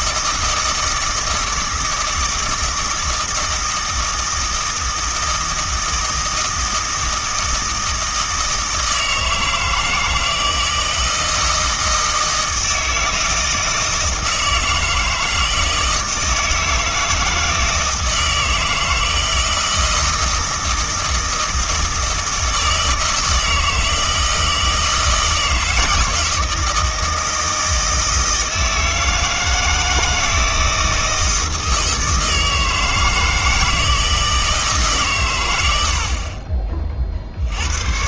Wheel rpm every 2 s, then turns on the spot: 160, 160, 160, 160, 160, 160, 160, 160, 160, 160, 160, 160, 160, 160, 160, 160, 160, 150, 40.
none